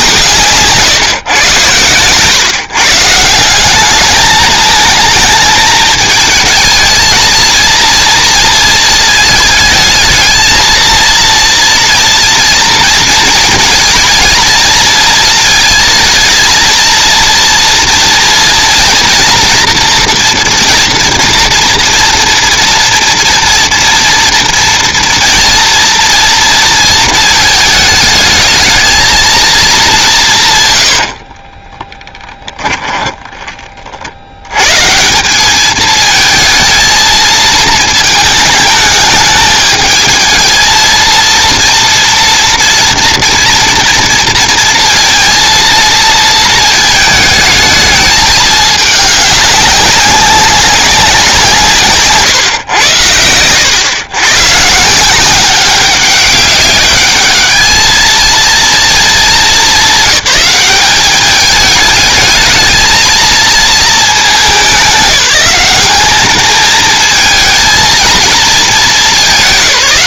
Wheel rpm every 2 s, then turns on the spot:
130, 150, 220, 220, 220, 230, 230, 230, 230, 240, 230, 230, 240, 220, 220, 50, 10, 170, 230, 210, 220, 230, 230, 220, 210, 190, 120, 160, 200, 220, 190, 220, 190, 220, 220.
30-34